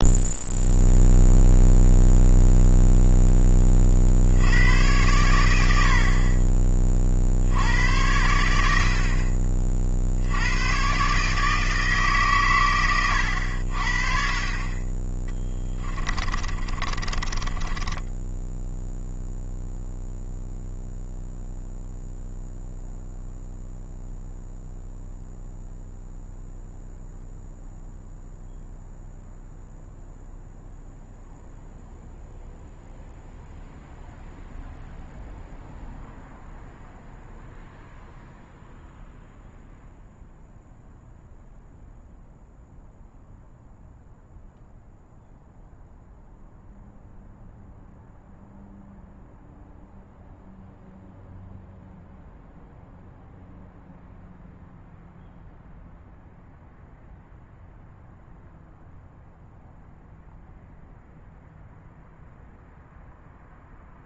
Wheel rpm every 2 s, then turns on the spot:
0, 0, 100, 30, 70, 110, 110, 30, 30, 0, 0, 0, 0, 0, 0, 0, 0, 0, 0, 0, 0, 0, 0, 0, 0, 0, 0, 0, 0, 0, 0, 0.
16-18